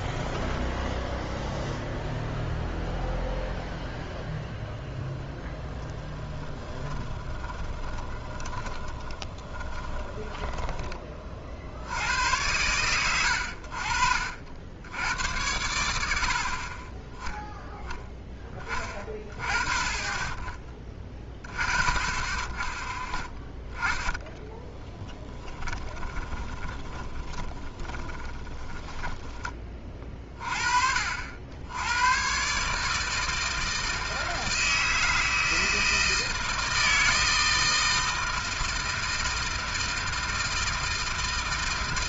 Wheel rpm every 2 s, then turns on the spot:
0, 0, 0, 10, 20, 20, 100, 70, 40, 10, 20, 20, 10, 20, 20, 40, 140, 160, 160, 160, 160.
6-12 26-30